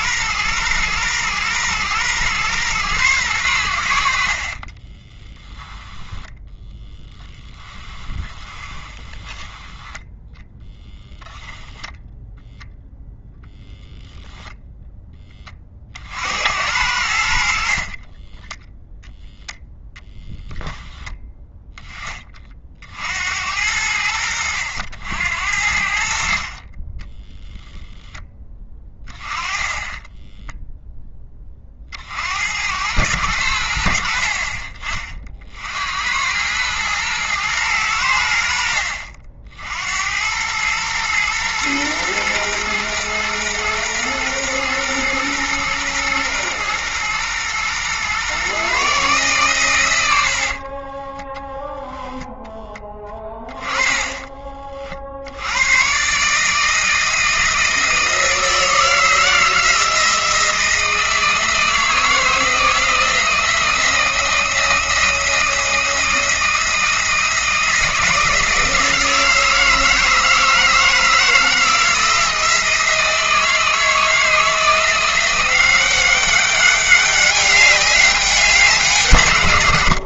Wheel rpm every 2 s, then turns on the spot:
120, 120, 30, 10, 20, 0, 0, 10, 80, 0, 10, 60, 80, 30, 10, 10, 100, 40, 110, 60, 110, 120, 120, 120, 140, 20, 10, 50, 160, 160, 160, 160, 160, 160, 160, 160, 160, 170, 200, 150.
4-10 50-52